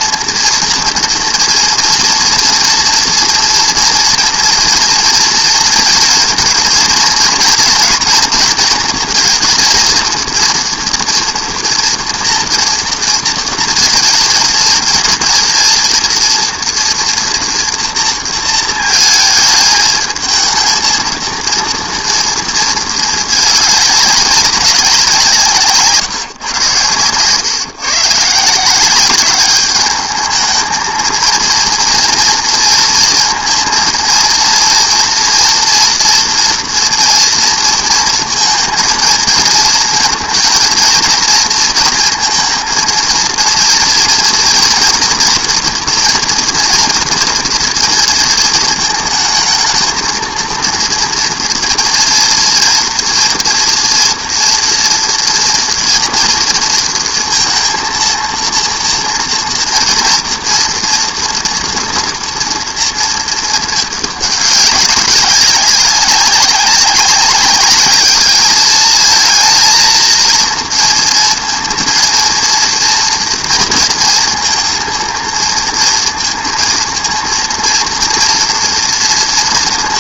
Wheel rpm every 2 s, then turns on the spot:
230, 240, 230, 230, 230, 230, 230, 220, 230, 230, 220, 230, 190, 130, 160, 210, 230, 230, 230, 220, 230, 230, 230, 230, 220, 230, 230, 230, 230, 230, 230, 230, 200, 200, 210, 230, 230, 230, 230, 230.
none